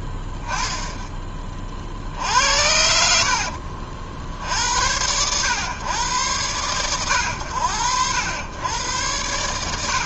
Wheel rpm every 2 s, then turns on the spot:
10, 90, 70, 110, 100.
none